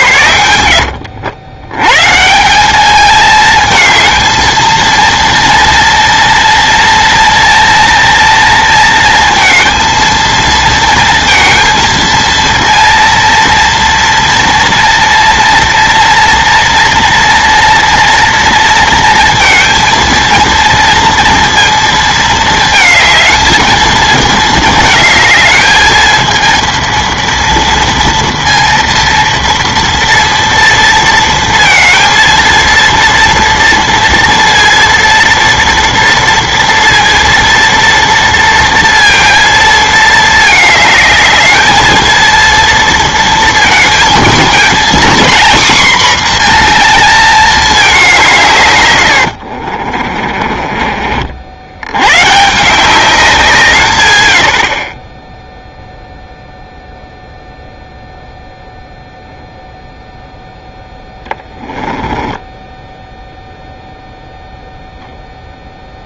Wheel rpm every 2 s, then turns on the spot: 90, 190, 230, 230, 230, 230, 230, 230, 240, 230, 230, 220, 220, 230, 230, 230, 230, 230, 230, 230, 220, 230, 230, 230, 120, 30, 170, 60, 0, 0, 0, 10, 0.
62-64